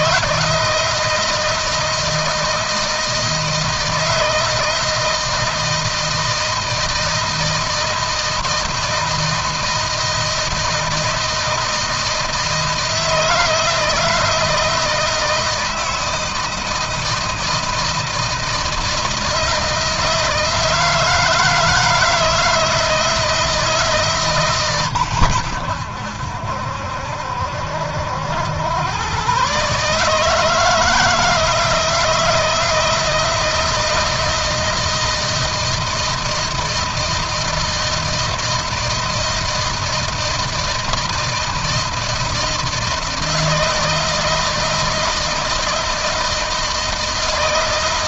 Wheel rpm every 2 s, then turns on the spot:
160, 160, 160, 160, 160, 160, 160, 160, 160, 160, 160, 160, 120, 70, 110, 160, 160, 160, 160, 160, 160, 160, 160, 160.
none